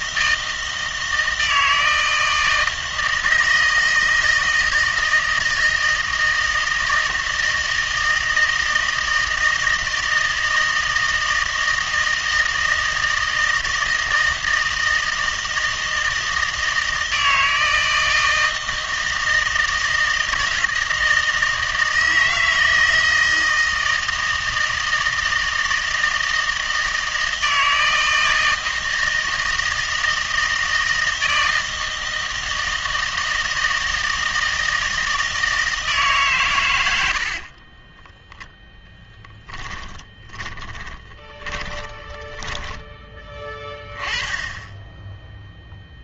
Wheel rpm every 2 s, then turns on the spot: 160, 160, 160, 160, 160, 160, 160, 160, 160, 160, 160, 160, 160, 160, 160, 160, 160, 160, 130, 10, 30, 20, 10.
40-42